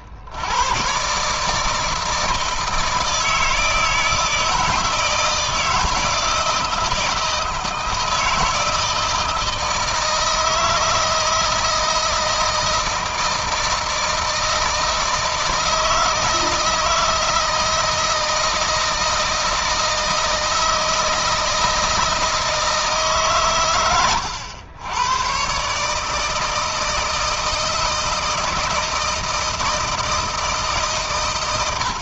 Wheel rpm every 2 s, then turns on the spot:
120, 160, 160, 160, 160, 160, 160, 160, 160, 160, 160, 150, 110, 160, 160, 140.
none